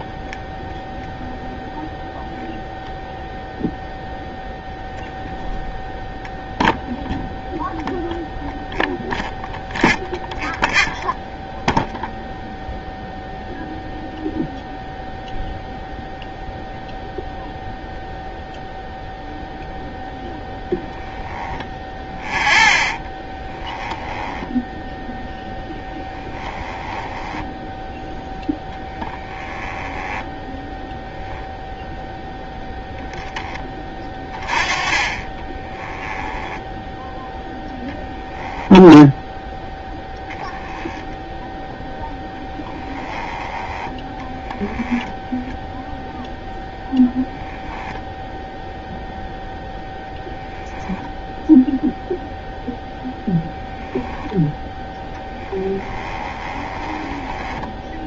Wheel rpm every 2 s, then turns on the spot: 0, 0, 0, 0, 0, 0, 0, 0, 0, 0, 0, 10, 10, 10, 10, 0, 0, 20, 10, 0, 0, 10, 10, 0, 0, 0, 10, 10, 20.
24-30 34-36 44-46 56-58